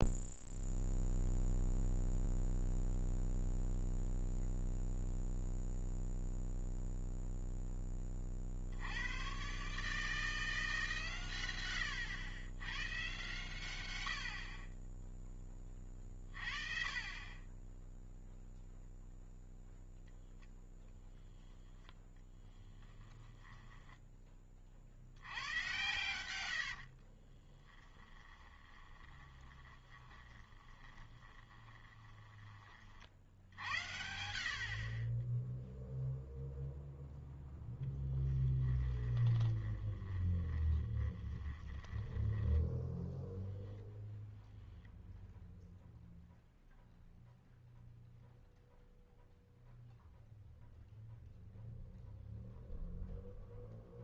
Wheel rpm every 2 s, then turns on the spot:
0, 0, 0, 0, 70, 160, 110, 30, 30, 0, 10, 10, 40, 70, 20, 20, 40, 50, 0, 20, 20, 10, 0, 0, 0, 0, 0.
22-24 26-32 38-44